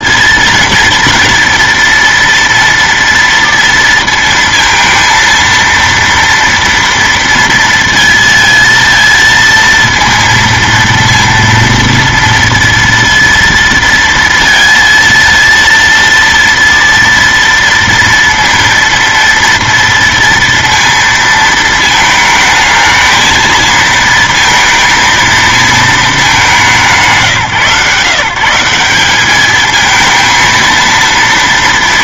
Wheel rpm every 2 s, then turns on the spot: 230, 230, 230, 230, 230, 230, 230, 230, 230, 230, 230, 220, 230, 150, 180, 230.
none